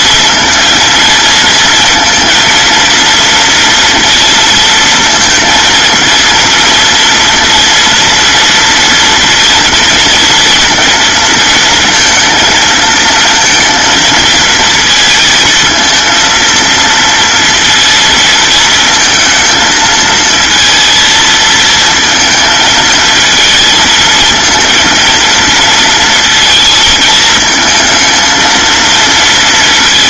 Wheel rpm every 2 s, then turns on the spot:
230, 230, 230, 230, 230, 230, 230, 220, 230, 220, 230, 220, 230, 230, 230.
none